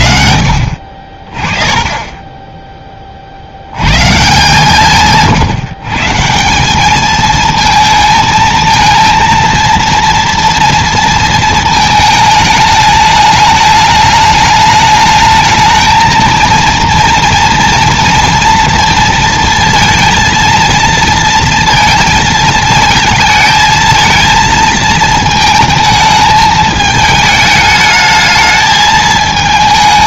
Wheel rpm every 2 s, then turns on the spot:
50, 20, 160, 200, 220, 230, 210, 210, 230, 230, 230, 220, 220, 220, 220.
none